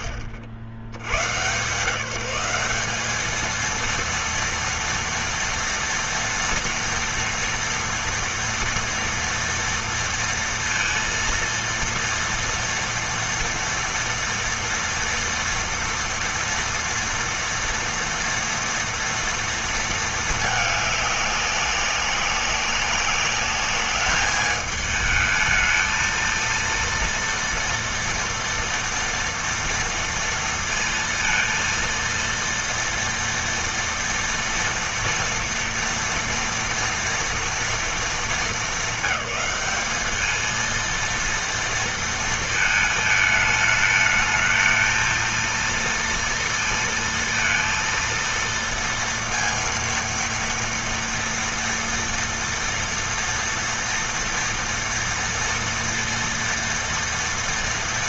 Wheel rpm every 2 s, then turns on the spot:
80, 210, 230, 240, 230, 230, 230, 230, 230, 230, 200, 200, 220, 230, 230, 230, 230, 230, 230, 210, 230, 220, 230, 230, 230, 230, 230, 230, 230.
none